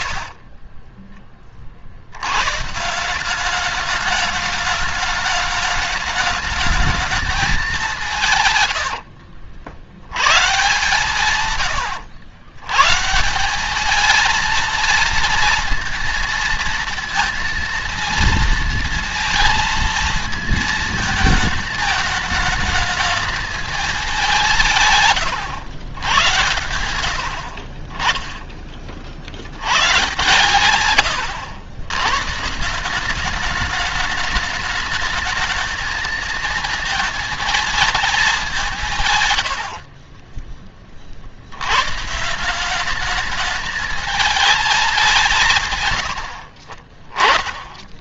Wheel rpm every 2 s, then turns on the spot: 40, 100, 210, 220, 160, 110, 120, 220, 230, 230, 220, 210, 180, 100, 20, 130, 140, 210, 220, 210, 30, 160, 220, 70.
40-42